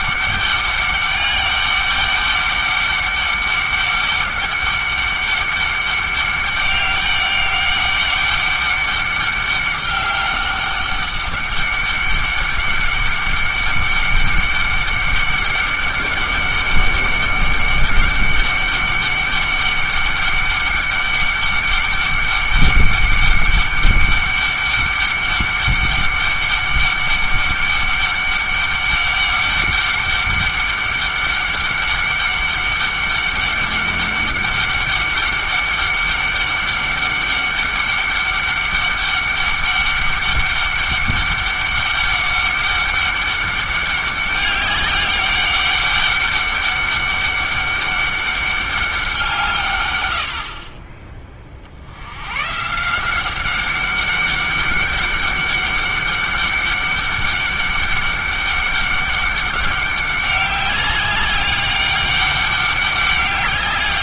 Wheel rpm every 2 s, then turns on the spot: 200, 200, 200, 200, 200, 200, 200, 200, 200, 200, 200, 200, 200, 200, 200, 200, 200, 200, 200, 200, 200, 200, 200, 200, 200, 40, 150, 200, 200, 200, 190, 200.
none